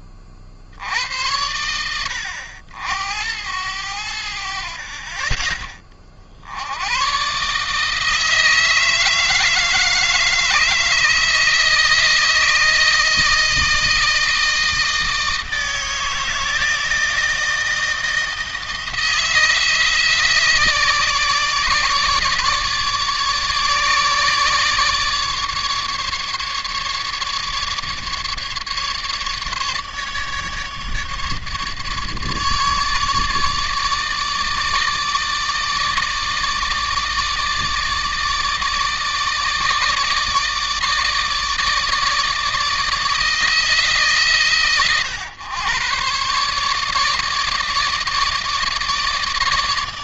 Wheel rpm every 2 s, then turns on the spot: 60, 90, 60, 80, 160, 160, 160, 160, 160, 160, 160, 150, 150, 150, 150, 150, 150, 150, 160, 150, 160, 160, 130, 140, 160.
none